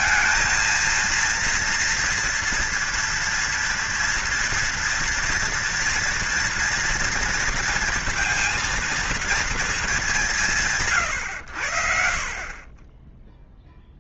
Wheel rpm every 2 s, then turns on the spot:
230, 230, 230, 230, 230, 140, 30.
none